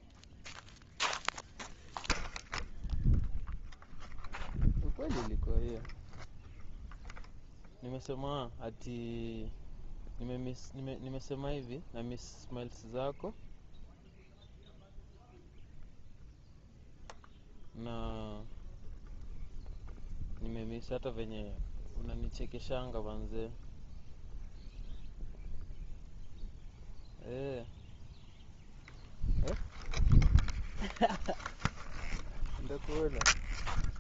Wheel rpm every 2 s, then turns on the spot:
0, 0, 0, 0, 0, 0, 0, 0, 0, 0, 0, 0, 0, 0, 0, 0, 0.
none